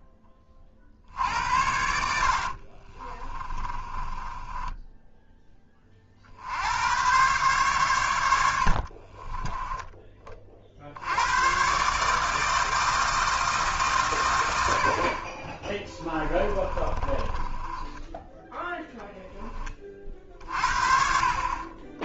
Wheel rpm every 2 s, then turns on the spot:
50, 40, 10, 90, 60, 60, 160, 90, 30, 10, 50.
2-6 8-10 16-18